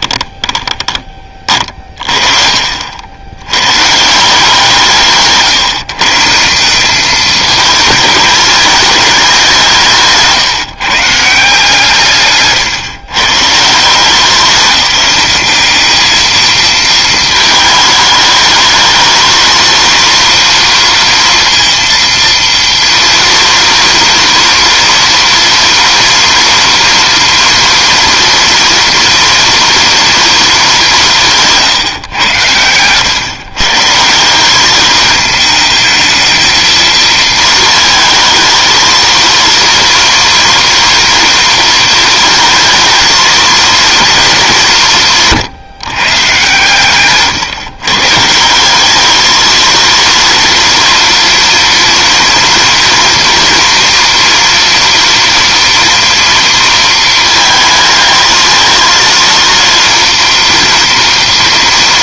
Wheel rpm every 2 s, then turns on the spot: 10, 50, 160, 190, 220, 150, 130, 200, 220, 210, 230, 230, 230, 230, 230, 210, 110, 200, 230, 220, 230, 220, 200, 130, 190, 230, 230, 230, 230, 220, 230.
0-2